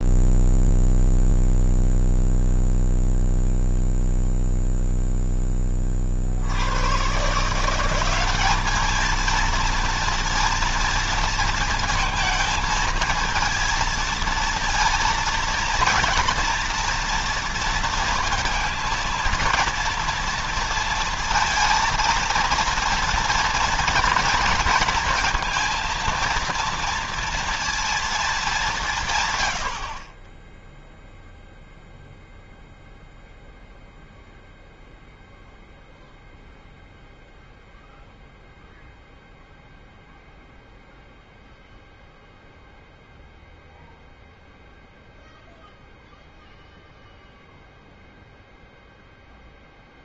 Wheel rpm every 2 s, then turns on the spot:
0, 0, 0, 110, 220, 230, 230, 230, 230, 230, 230, 230, 230, 230, 170, 0, 0, 0, 0, 0, 0, 0, 0, 0, 0.
none